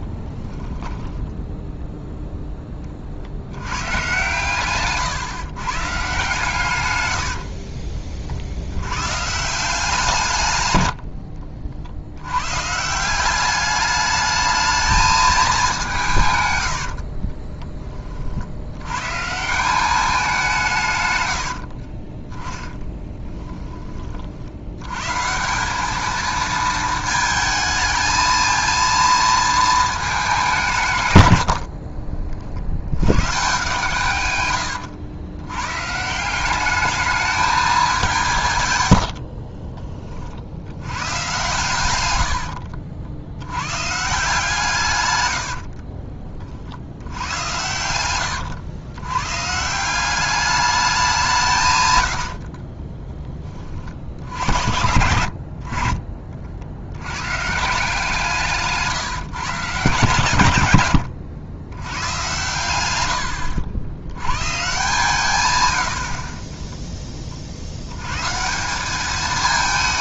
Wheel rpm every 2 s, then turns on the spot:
20, 30, 130, 120, 100, 100, 150, 220, 90, 110, 150, 10, 110, 220, 230, 140, 90, 100, 210, 110, 100, 80, 130, 70, 110, 200, 40, 80, 80, 160, 120, 100, 150, 10, 190.
0-2 16-18 22-24 38-40 52-54